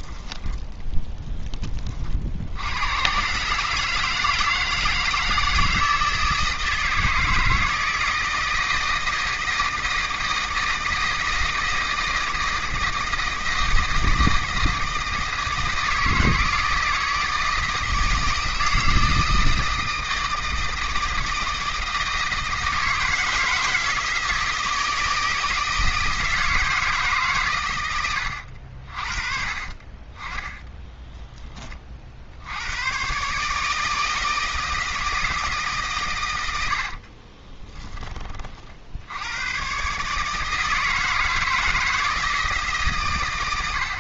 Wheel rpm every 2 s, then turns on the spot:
10, 100, 160, 160, 160, 160, 160, 160, 160, 160, 160, 160, 160, 160, 60, 10, 100, 160, 70, 60, 160, 140.
30-32 36-38